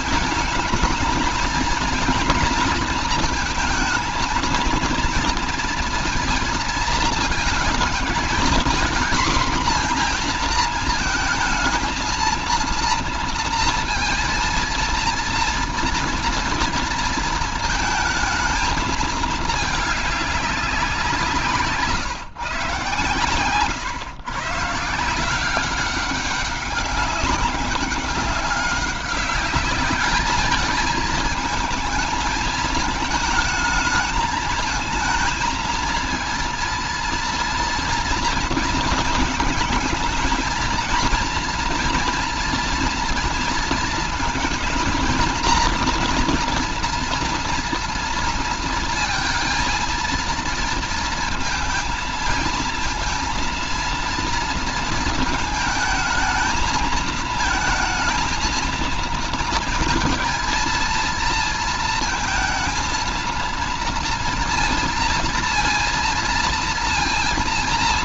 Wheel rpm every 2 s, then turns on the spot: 230, 230, 230, 230, 230, 230, 230, 230, 230, 220, 190, 140, 140, 200, 200, 220, 220, 220, 230, 230, 230, 230, 230, 230, 230, 230, 220, 230, 220, 220, 230, 230, 230, 230.
none